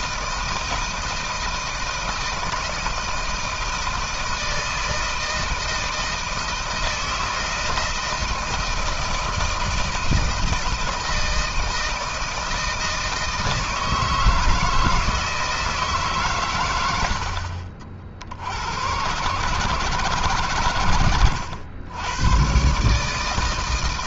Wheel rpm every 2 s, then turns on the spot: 160, 160, 160, 160, 160, 160, 160, 160, 120, 80, 110, 120.
none